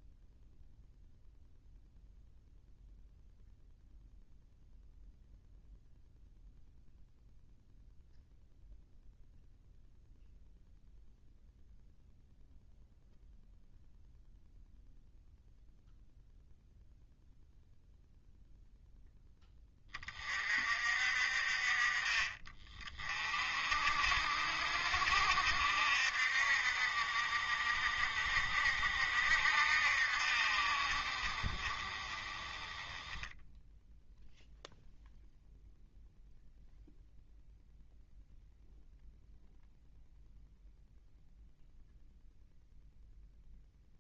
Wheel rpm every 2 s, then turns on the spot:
0, 0, 0, 0, 0, 0, 0, 0, 0, 0, 50, 30, 60, 50, 50, 50, 20, 0, 0, 0, 0, 0.
none